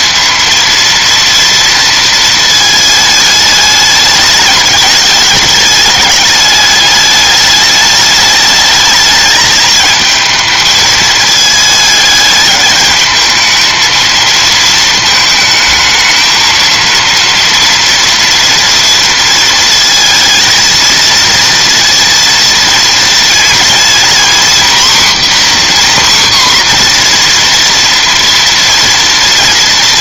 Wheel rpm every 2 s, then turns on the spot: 230, 220, 210, 210, 210, 220, 220, 230, 220, 240, 220, 230, 250, 250, 230.
none